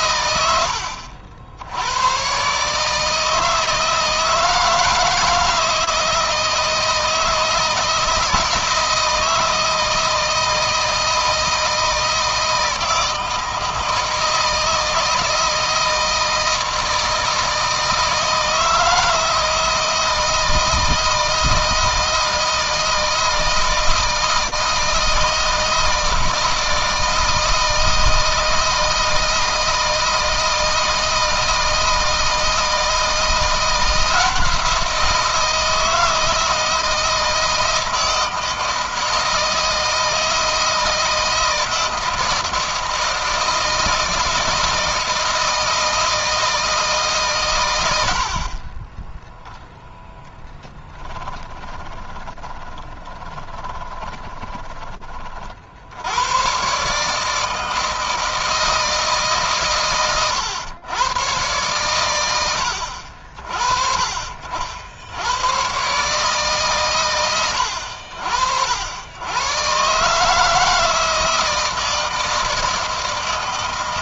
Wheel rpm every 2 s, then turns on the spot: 80, 150, 160, 160, 160, 160, 160, 160, 160, 160, 160, 160, 160, 160, 160, 160, 170, 170, 160, 160, 160, 160, 160, 150, 20, 10, 20, 30, 140, 160, 120, 70, 80, 120, 80, 160, 160.
50-54